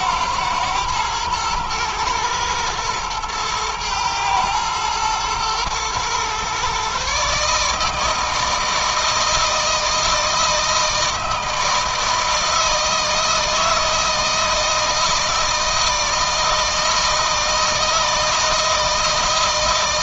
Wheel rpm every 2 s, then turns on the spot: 110, 110, 110, 130, 160, 160, 160, 160, 160, 160.
none